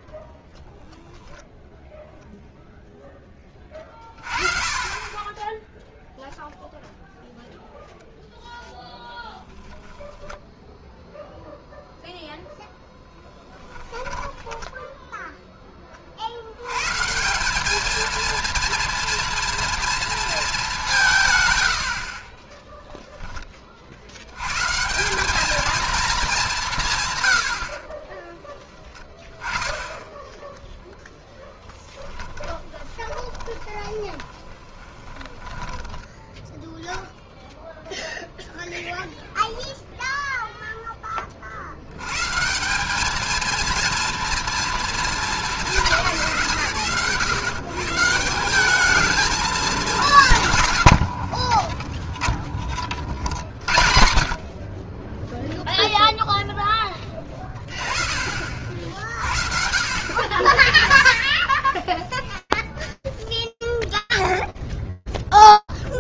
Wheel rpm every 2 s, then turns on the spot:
0, 30, 0, 0, 0, 0, 10, 30, 220, 230, 70, 60, 230, 50, 0, 20, 20, 10, 0, 0, 100, 230, 220, 140, 210, 30, 60, 0, 30, 40, 0, 0, 0.
30-34 50-52